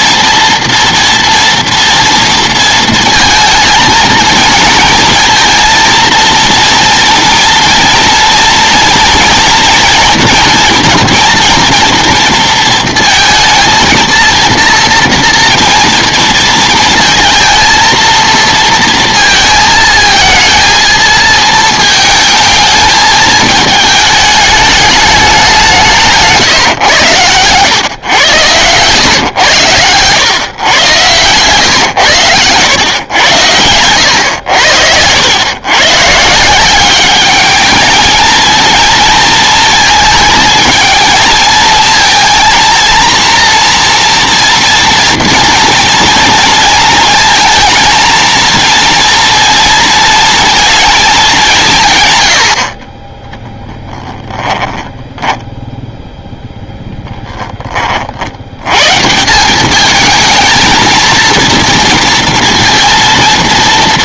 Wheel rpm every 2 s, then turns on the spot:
230, 230, 220, 230, 230, 230, 230, 230, 230, 230, 220, 220, 220, 130, 110, 110, 110, 80, 190, 220, 220, 230, 230, 230, 230, 220, 40, 10, 0, 120, 220, 230.
28-30 54-56